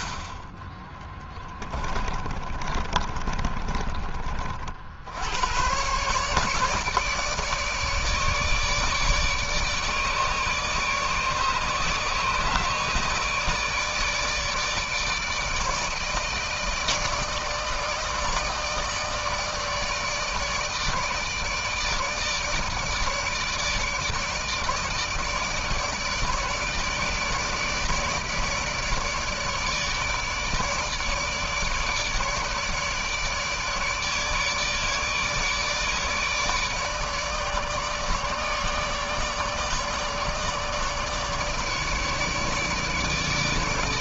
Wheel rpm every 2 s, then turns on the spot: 20, 30, 60, 150, 150, 150, 150, 150, 160, 160, 150, 150, 160, 150, 150, 150, 150, 150, 150, 150, 150, 150.
0-4